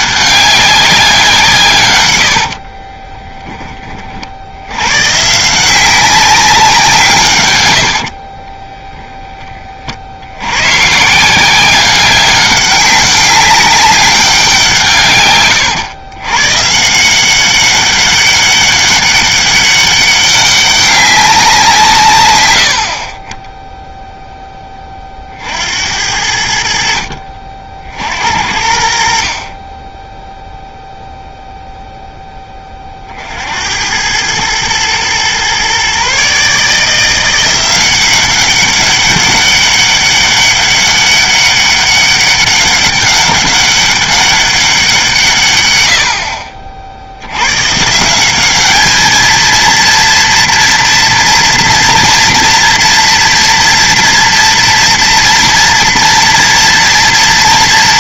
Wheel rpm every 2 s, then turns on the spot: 190, 40, 80, 180, 10, 140, 200, 150, 160, 200, 200, 70, 20, 70, 70, 0, 30, 110, 160, 200, 200, 200, 190, 50, 210, 230, 230, 230, 240.
2-4 8-10